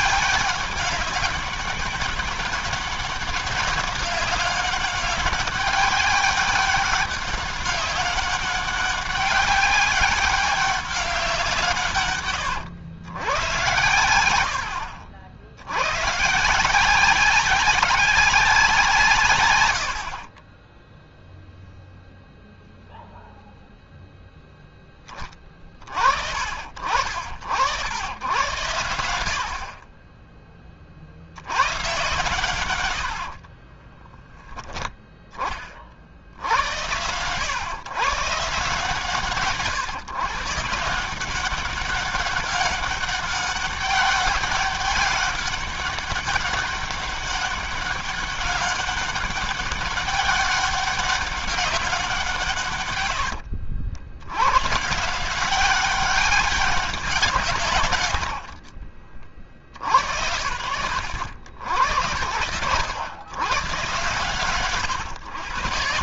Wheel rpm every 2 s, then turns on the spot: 190, 200, 200, 200, 200, 190, 110, 100, 140, 180, 40, 0, 0, 50, 110, 30, 110, 10, 70, 140, 130, 200, 200, 200, 200, 200, 150, 90, 190, 90, 90, 100, 130.
20-22 58-60